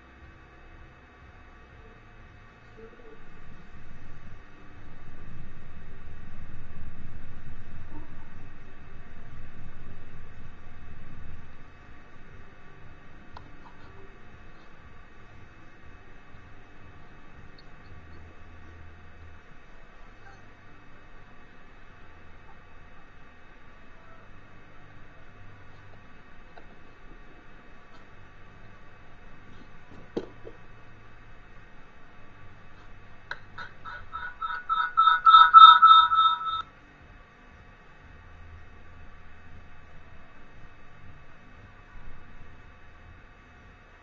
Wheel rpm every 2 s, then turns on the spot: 0, 0, 0, 0, 0, 0, 0, 0, 0, 0, 0, 0, 0, 0, 0, 0, 0, 0, 0, 0, 0, 0.
none